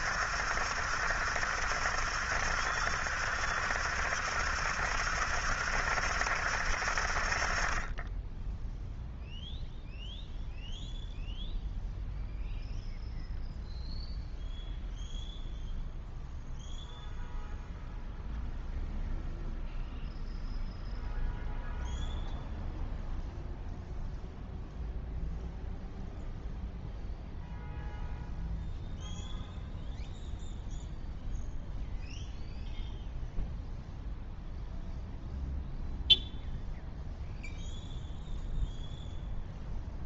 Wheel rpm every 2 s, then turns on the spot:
70, 70, 70, 60, 0, 0, 0, 0, 0, 0, 0, 0, 0, 0, 0, 0, 0, 0, 0, 0.
none